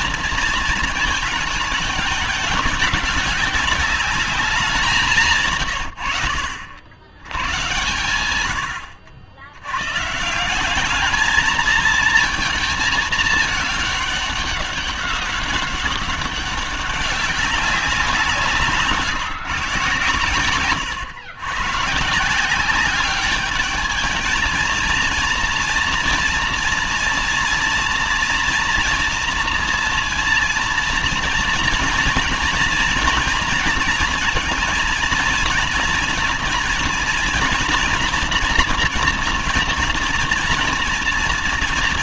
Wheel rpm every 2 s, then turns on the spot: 230, 200, 190, 80, 90, 190, 220, 200, 200, 160, 120, 190, 220, 230, 230, 230, 230, 230, 230, 240, 240.
none